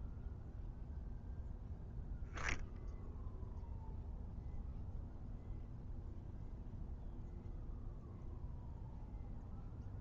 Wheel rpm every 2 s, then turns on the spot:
0, 0, 0, 0, 0.
none